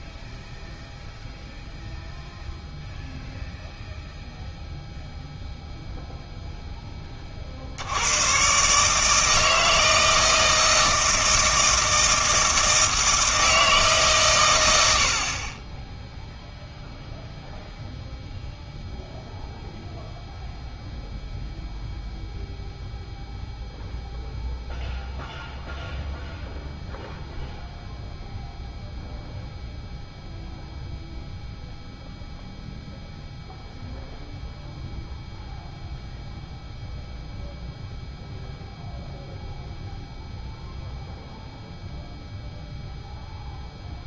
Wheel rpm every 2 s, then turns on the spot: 0, 0, 0, 10, 130, 160, 160, 90, 0, 0, 0, 0, 0, 0, 0, 0, 0, 0, 0, 0, 0, 0.
none